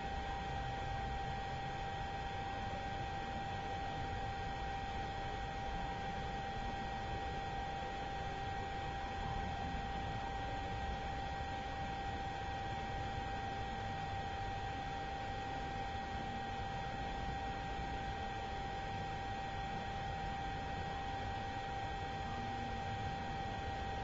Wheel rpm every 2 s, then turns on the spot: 0, 0, 0, 0, 0, 0, 0, 0, 0, 0, 0, 0.
none